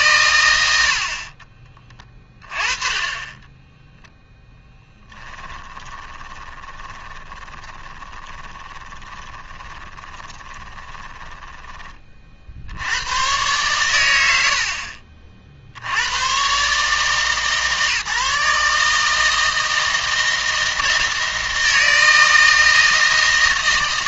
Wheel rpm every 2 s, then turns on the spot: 80, 20, 10, 20, 20, 20, 80, 50, 140, 150, 160, 160.
4-12